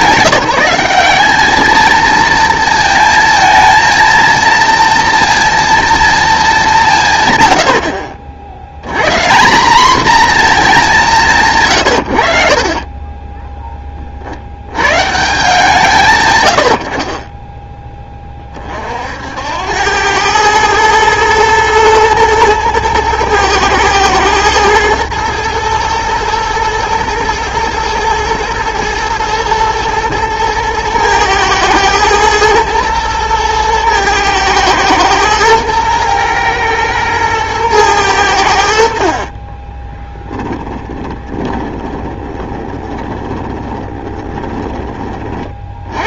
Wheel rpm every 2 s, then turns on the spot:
190, 230, 230, 170, 90, 220, 50, 90, 70, 40, 110, 110, 110, 110, 110, 110, 110, 110, 110, 80, 20, 20, 20.
40-46